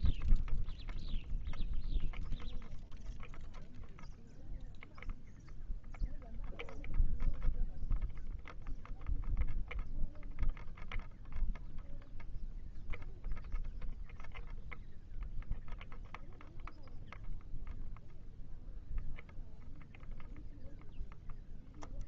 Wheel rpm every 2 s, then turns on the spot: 0, 0, 0, 0, 0, 0, 0, 0, 0, 0, 0.
none